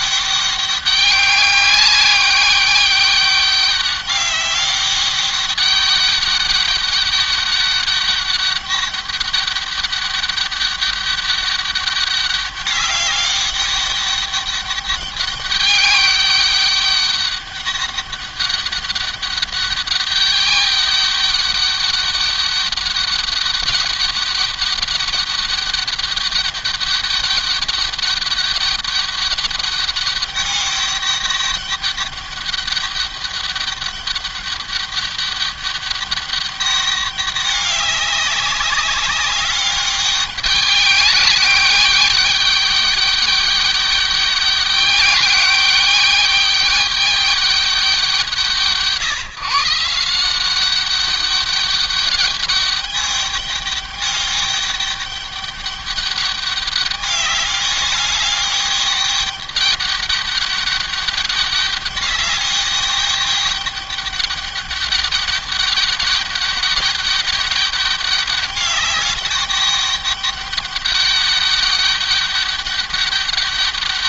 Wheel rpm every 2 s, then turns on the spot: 200, 200, 200, 200, 200, 200, 200, 200, 200, 200, 200, 200, 200, 200, 200, 200, 200, 200, 200, 190, 200, 200, 200, 200, 150, 200, 200, 200, 200, 200, 200, 200, 200, 200, 200, 200, 200.
none